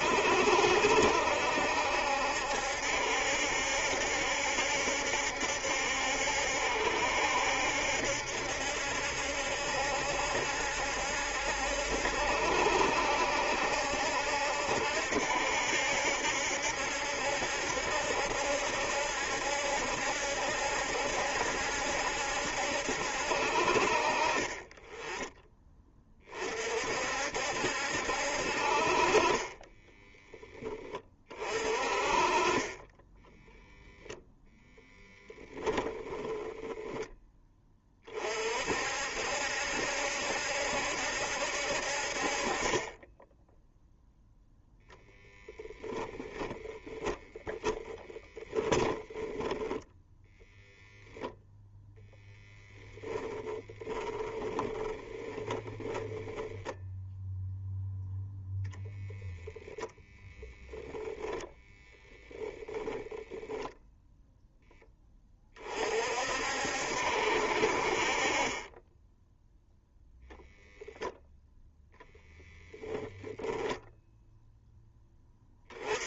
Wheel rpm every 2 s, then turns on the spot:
70, 70, 70, 70, 70, 70, 70, 70, 70, 70, 70, 70, 30, 50, 40, 30, 10, 0, 10, 60, 70, 20, 0, 20, 20, 0, 10, 10, 10, 0, 0, 10, 10, 60, 20, 0, 0, 0.
46-50 54-58 62-64